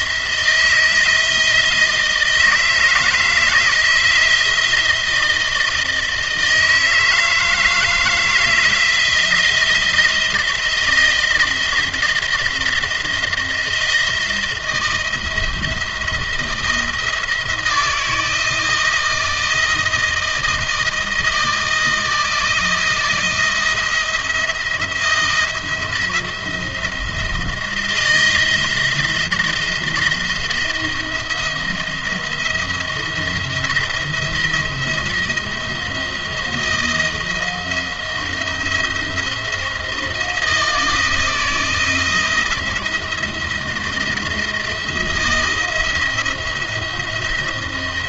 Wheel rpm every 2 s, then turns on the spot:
160, 160, 170, 160, 160, 170, 170, 170, 160, 160, 170, 170, 170, 170, 170, 170, 170, 170, 170, 170, 160, 170, 170, 170.
none